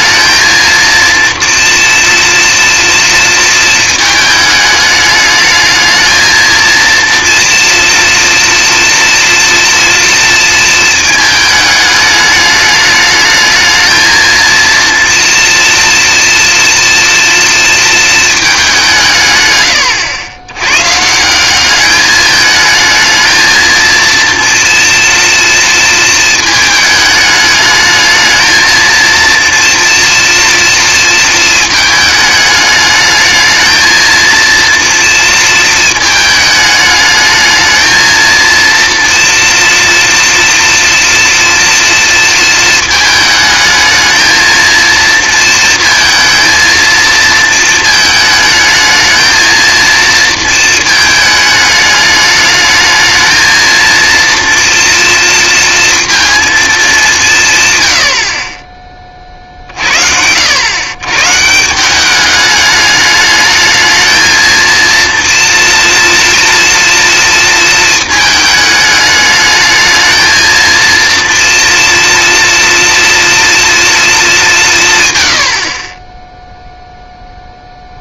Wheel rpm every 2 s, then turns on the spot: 230, 230, 210, 220, 230, 230, 210, 230, 240, 210, 120, 220, 230, 220, 220, 230, 210, 230, 220, 230, 230, 230, 220, 230, 220, 230, 210, 240, 220, 20, 100, 210, 230, 240, 220, 230, 230, 200, 0.
none